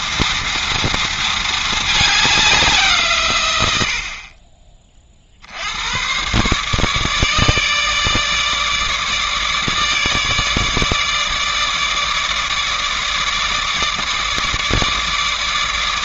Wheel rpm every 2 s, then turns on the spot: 230, 180, 30, 140, 150, 150, 150, 150.
none